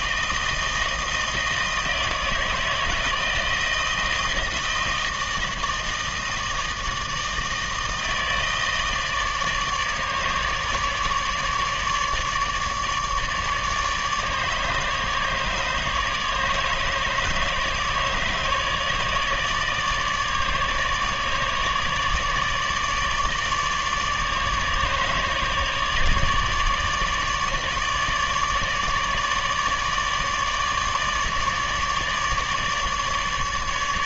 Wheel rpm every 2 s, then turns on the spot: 160, 160, 160, 160, 160, 150, 150, 150, 150, 150, 150, 150, 150, 150, 150, 150, 150.
none